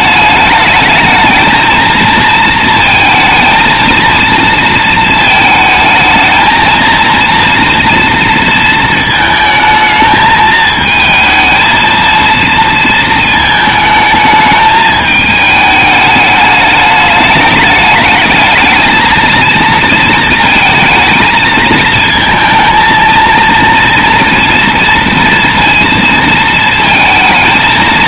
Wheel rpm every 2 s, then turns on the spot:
210, 230, 230, 220, 230, 220, 230, 210, 210, 220, 230, 220, 230, 230.
none